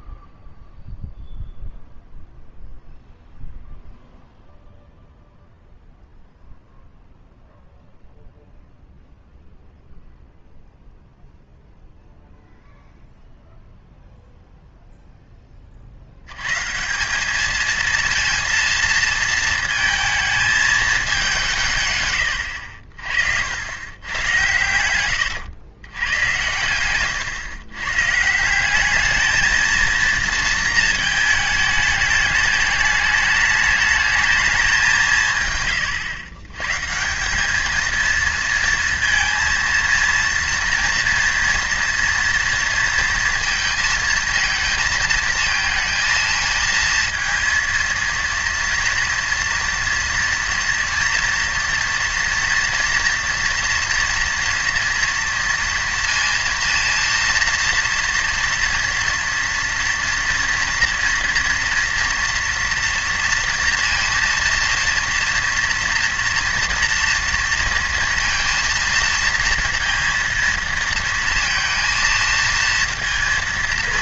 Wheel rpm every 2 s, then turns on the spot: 0, 0, 0, 0, 0, 0, 0, 30, 220, 220, 160, 80, 100, 130, 220, 220, 210, 130, 210, 230, 230, 230, 230, 230, 230, 230, 230, 230, 230, 230, 230, 230, 230, 230, 230, 230, 230.
none